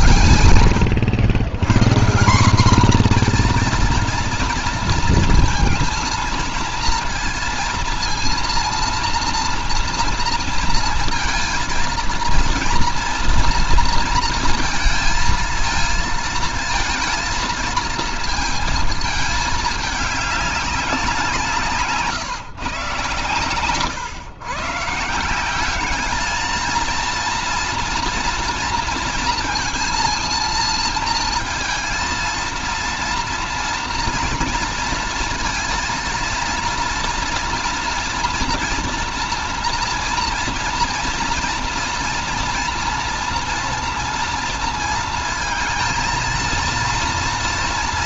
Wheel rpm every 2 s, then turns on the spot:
130, 200, 230, 230, 230, 230, 230, 230, 230, 220, 200, 140, 130, 220, 230, 230, 230, 230, 230, 240, 230, 230, 230, 230.
none